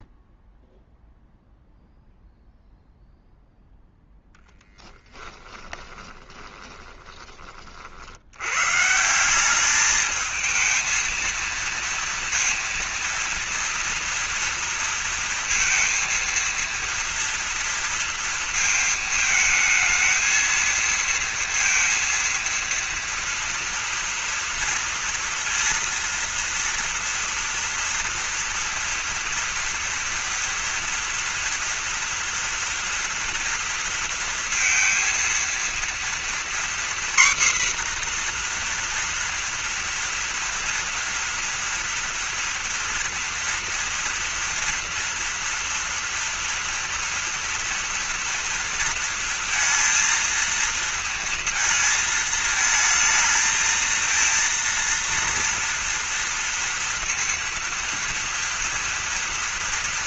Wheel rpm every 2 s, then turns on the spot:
0, 0, 10, 20, 130, 220, 230, 230, 230, 230, 230, 230, 230, 230, 240, 230, 230, 230, 250, 240, 230, 230, 230, 230, 230, 230, 220, 230, 230, 230.
4-8